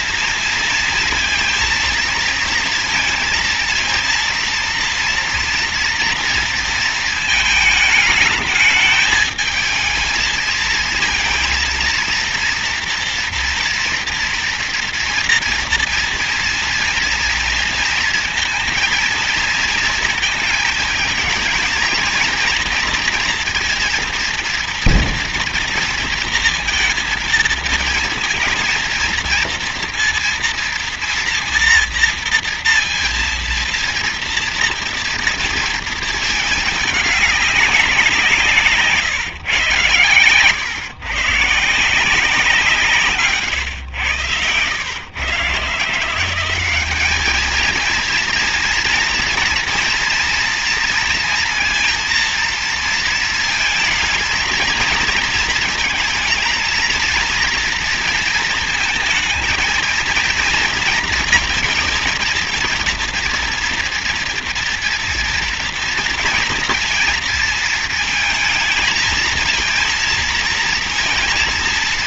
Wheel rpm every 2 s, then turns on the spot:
230, 230, 230, 230, 220, 230, 240, 240, 230, 220, 220, 230, 230, 230, 230, 230, 230, 230, 210, 150, 130, 160, 120, 210, 230, 230, 230, 230, 230, 220, 230, 230, 230, 230, 230, 230.
none